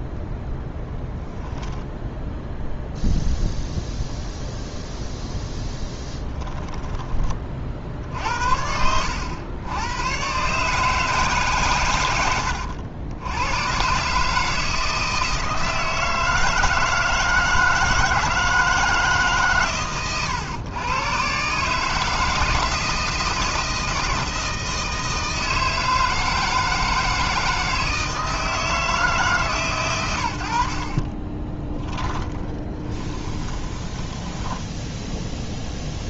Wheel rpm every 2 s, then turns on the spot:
10, 0, 0, 30, 80, 150, 90, 160, 160, 160, 110, 160, 160, 160, 160, 50, 20, 10.
6-8 32-34